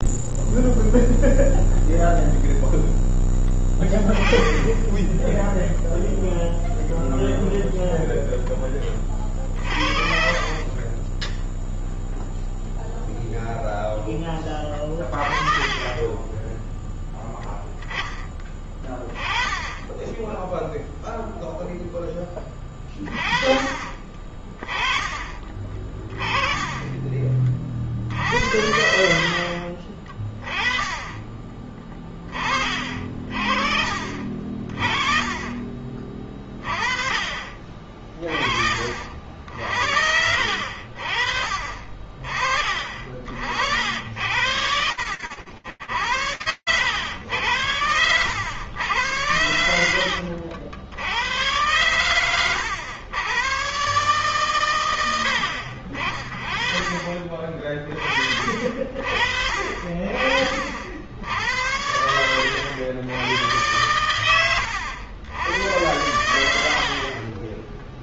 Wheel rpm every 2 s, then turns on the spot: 0, 0, 20, 0, 10, 30, 0, 10, 10, 10, 10, 10, 30, 20, 60, 20, 30, 50, 40, 40, 60, 40, 90, 100, 90, 90, 110, 100, 40, 60, 80, 100, 90, 30.
10-12 28-30